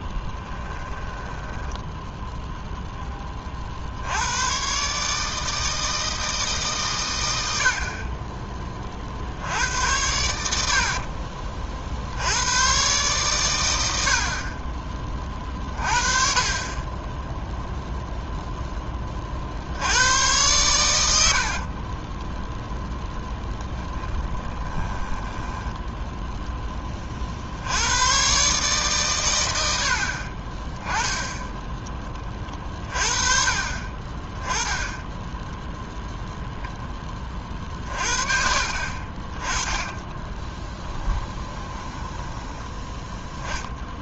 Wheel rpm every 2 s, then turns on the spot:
10, 0, 130, 140, 20, 70, 110, 30, 20, 10, 100, 0, 10, 20, 140, 20, 30, 10, 10, 50, 20, 10.
0-2 10-12 24-26 30-32 40-42